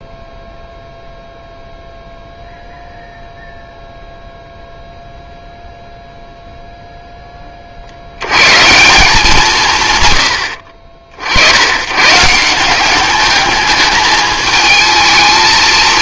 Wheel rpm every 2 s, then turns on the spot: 0, 0, 0, 0, 160, 60, 190, 220.
none